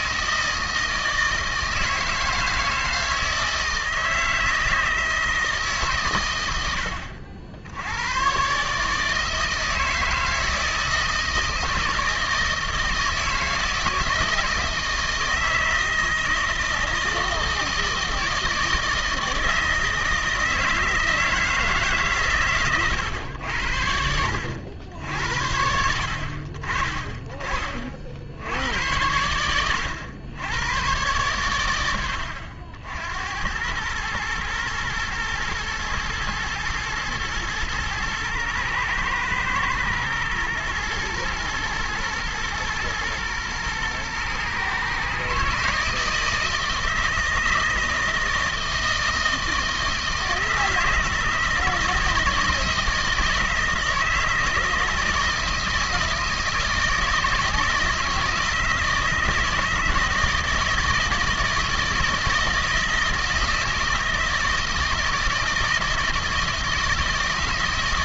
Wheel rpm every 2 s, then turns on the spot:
160, 160, 160, 100, 130, 160, 160, 160, 160, 160, 160, 120, 80, 50, 80, 100, 60, 120, 120, 120, 120, 120, 120, 160, 160, 160, 160, 160, 160, 160, 160, 160, 160, 160.
none